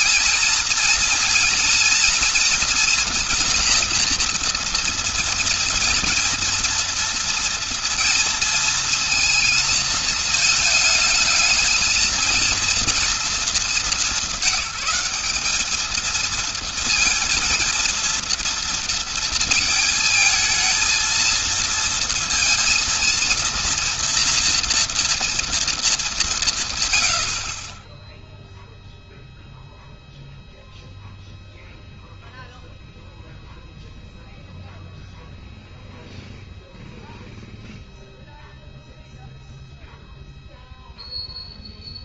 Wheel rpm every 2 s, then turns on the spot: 230, 230, 230, 230, 230, 220, 230, 210, 230, 230, 220, 230, 230, 160, 0, 0, 0, 0, 0, 0, 0.
none